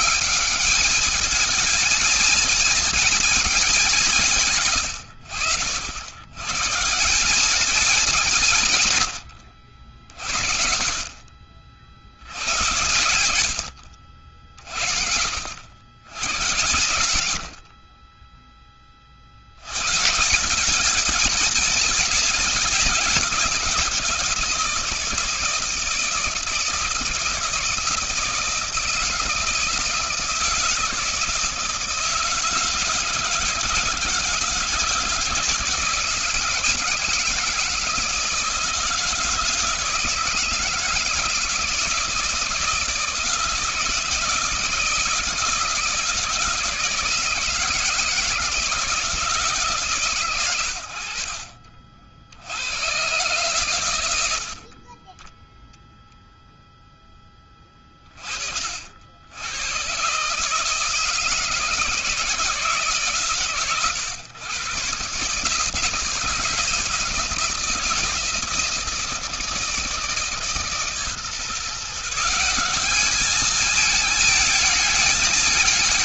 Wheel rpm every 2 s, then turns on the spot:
210, 230, 140, 120, 150, 70, 100, 60, 110, 20, 190, 190, 160, 160, 160, 160, 160, 160, 160, 160, 160, 170, 160, 160, 160, 110, 90, 50, 0, 60, 150, 160, 130, 160, 170, 150, 180, 220.
none